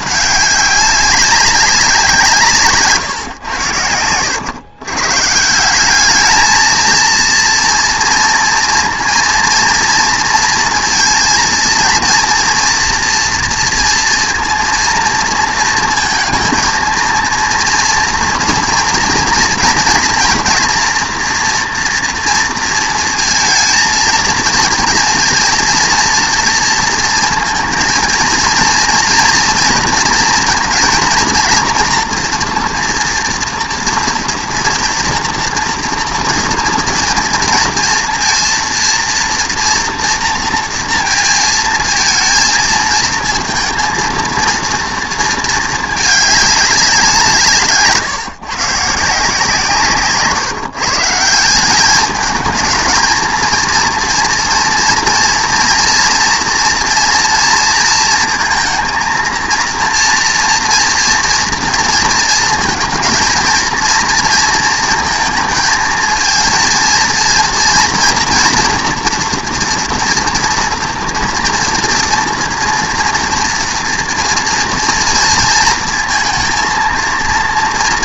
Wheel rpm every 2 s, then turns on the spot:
200, 150, 110, 220, 230, 230, 230, 230, 230, 230, 240, 230, 230, 230, 230, 230, 240, 230, 230, 230, 230, 220, 230, 200, 150, 140, 220, 230, 240, 230, 230, 230, 230, 230, 240, 230, 230, 230, 230.
none